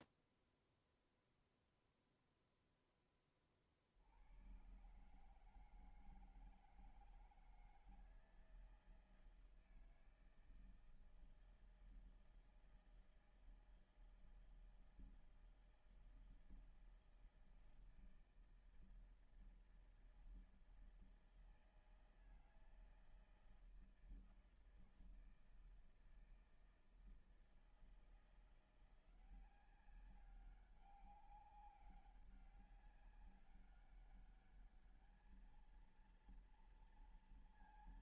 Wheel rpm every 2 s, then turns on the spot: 0, 0, 100, 160, 160, 160, 170, 160, 160, 160, 160, 160, 160, 160, 170, 190, 190, 210, 230.
none